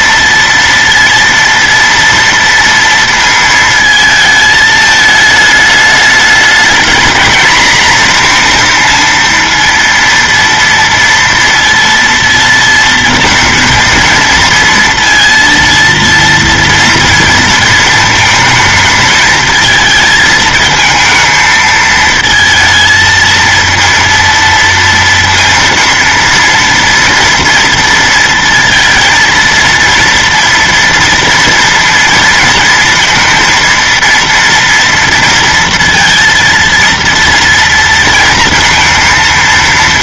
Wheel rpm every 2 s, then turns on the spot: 230, 230, 210, 220, 230, 230, 230, 230, 230, 220, 220, 230, 230, 230, 230, 230, 230, 240, 230, 230.
none